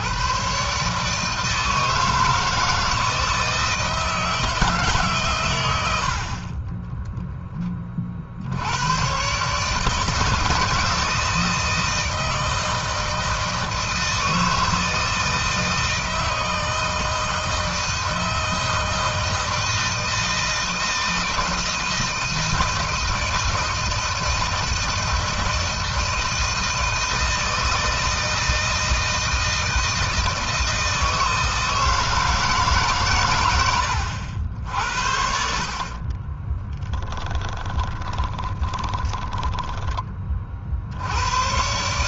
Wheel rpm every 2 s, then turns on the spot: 130, 160, 150, 20, 80, 160, 160, 160, 160, 160, 160, 170, 160, 160, 160, 160, 140, 70, 20, 30, 50.
6-8 36-40